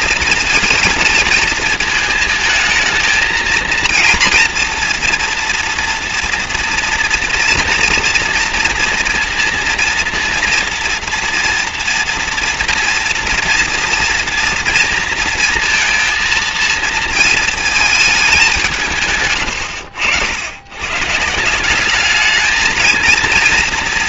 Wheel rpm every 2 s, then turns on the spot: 220, 220, 230, 230, 230, 230, 240, 230, 230, 170, 120, 220.
none